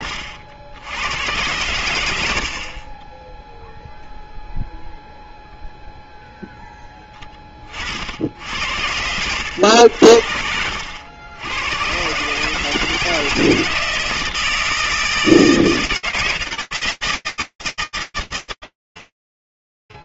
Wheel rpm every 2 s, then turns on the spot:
70, 60, 0, 0, 70, 70, 150, 160, 160, 120.
none